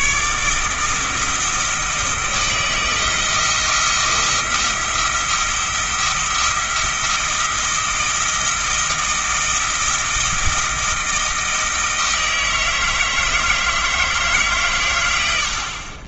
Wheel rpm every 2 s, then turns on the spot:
160, 160, 170, 170, 170, 170, 160, 110.
none